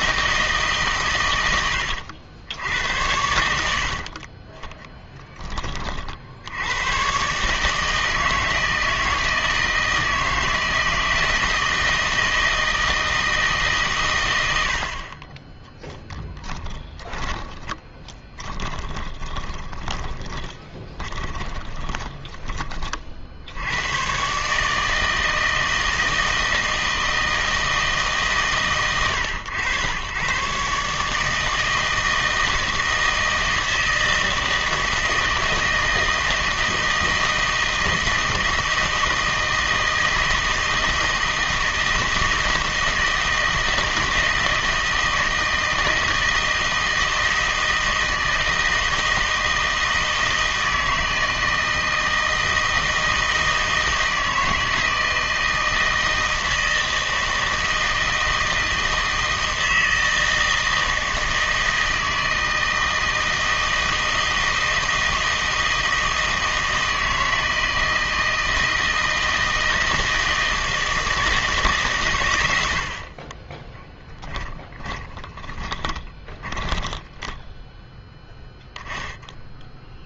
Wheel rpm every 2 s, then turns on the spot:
150, 90, 10, 100, 160, 160, 160, 90, 20, 20, 20, 30, 150, 160, 130, 140, 160, 160, 160, 160, 160, 160, 160, 160, 160, 160, 160, 160, 160, 160, 160, 160, 160, 160, 160, 160, 90, 20, 10, 10.
16-22 74-78